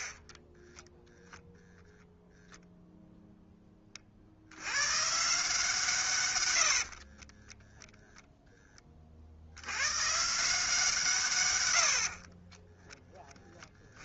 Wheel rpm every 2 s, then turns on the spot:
10, 0, 90, 90, 10, 160, 20.
0-2 6-8 12-14